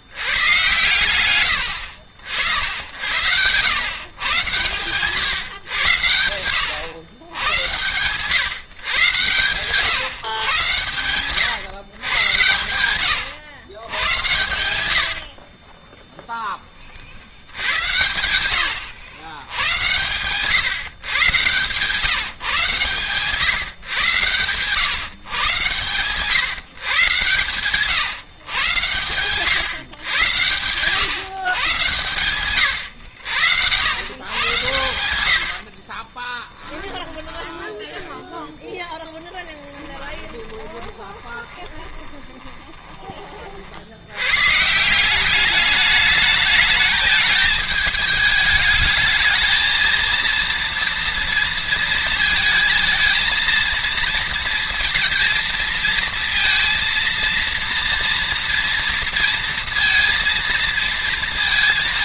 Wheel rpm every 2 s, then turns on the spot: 110, 70, 120, 90, 120, 130, 100, 70, 30, 110, 130, 140, 120, 120, 110, 120, 110, 100, 10, 20, 20, 20, 160, 210, 210, 230, 220, 230, 230, 230, 230.
14-16 38-42